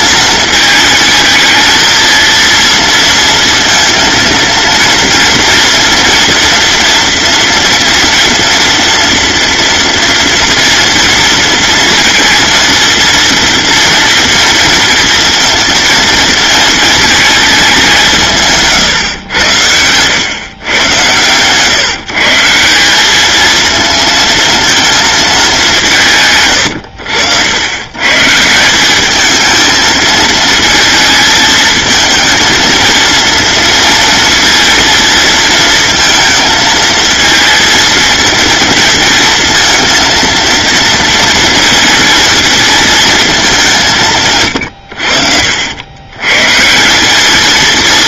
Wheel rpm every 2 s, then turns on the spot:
220, 230, 230, 240, 230, 230, 230, 230, 220, 140, 120, 170, 230, 90, 190, 220, 220, 230, 220, 230, 230, 230, 100, 170.
none